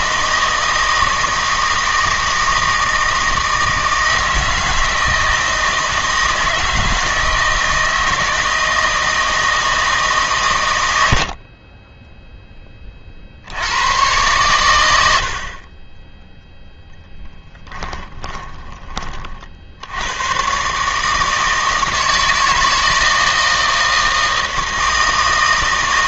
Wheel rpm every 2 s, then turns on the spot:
160, 160, 160, 160, 160, 100, 20, 100, 0, 20, 140, 160, 160.
none